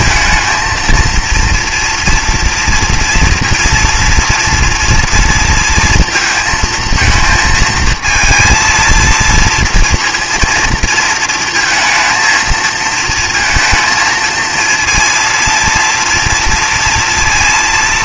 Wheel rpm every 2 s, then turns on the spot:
230, 230, 230, 230, 230, 230, 220, 230, 230.
none